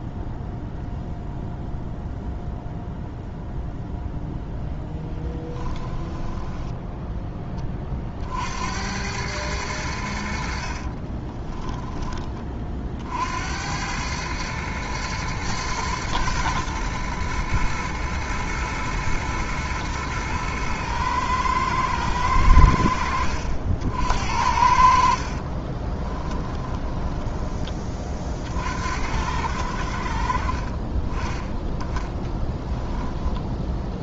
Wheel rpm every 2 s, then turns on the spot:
0, 0, 10, 10, 90, 50, 30, 110, 110, 110, 110, 80, 70, 20, 60, 30, 10.
6-8 10-12 26-28